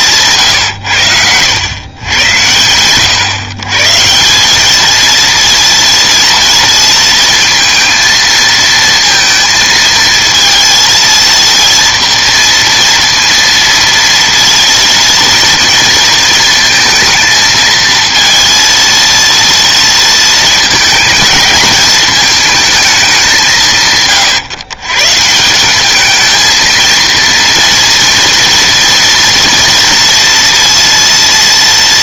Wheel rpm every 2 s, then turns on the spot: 130, 100, 200, 230, 230, 230, 230, 230, 220, 230, 220, 220, 130, 220, 230, 230.
none